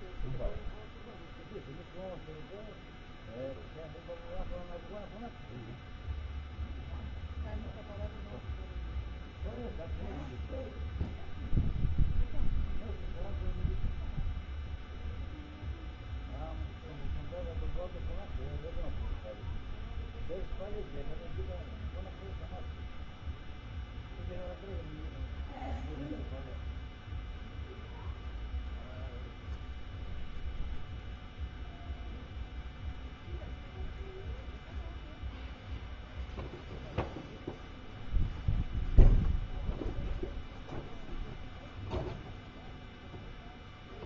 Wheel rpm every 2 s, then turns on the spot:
0, 0, 0, 0, 0, 0, 0, 0, 0, 0, 0, 0, 0, 0, 0, 0, 0, 0, 0, 0, 0, 0.
none